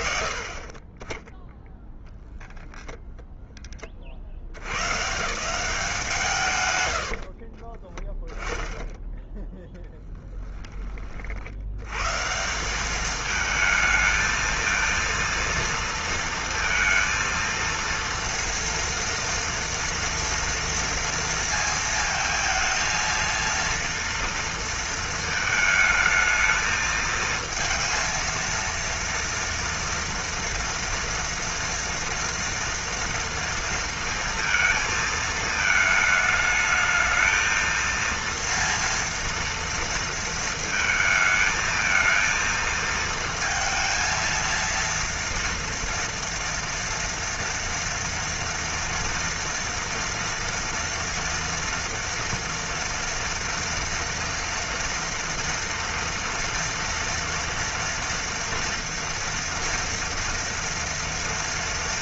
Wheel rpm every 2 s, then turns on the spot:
40, 10, 150, 110, 10, 30, 190, 230, 230, 240, 230, 220, 230, 220, 230, 230, 230, 220, 220, 230, 230, 230, 230, 230, 230, 230, 230, 230, 230, 240, 230.
8-10